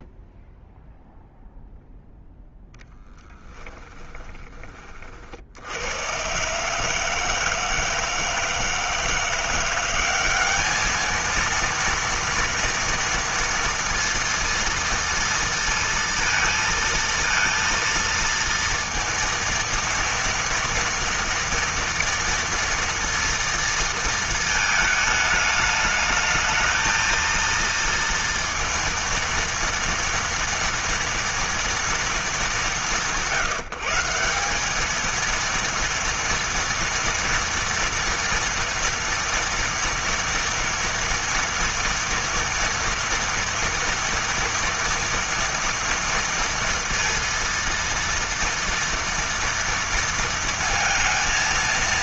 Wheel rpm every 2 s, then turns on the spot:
0, 10, 50, 150, 170, 210, 230, 230, 230, 230, 230, 230, 220, 230, 230, 240, 170, 220, 230, 230, 230, 230, 230, 230, 230, 230.
2-4